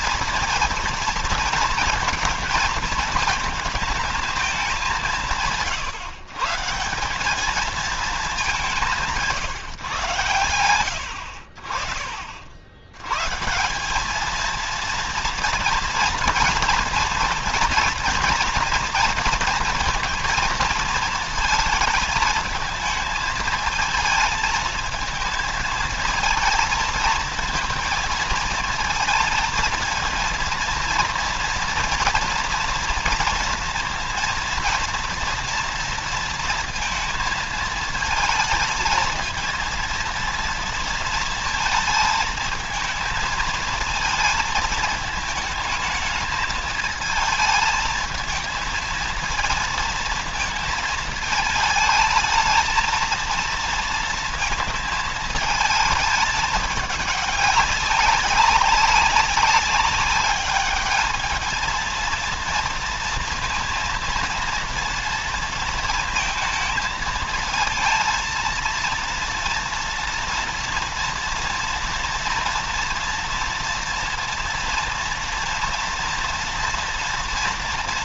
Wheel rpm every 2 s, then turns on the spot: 230, 230, 200, 170, 190, 90, 90, 230, 230, 230, 230, 220, 220, 220, 230, 230, 230, 230, 230, 220, 230, 220, 220, 220, 220, 220, 220, 220, 210, 200, 210, 230, 230, 220, 230, 230, 230, 230, 230.
none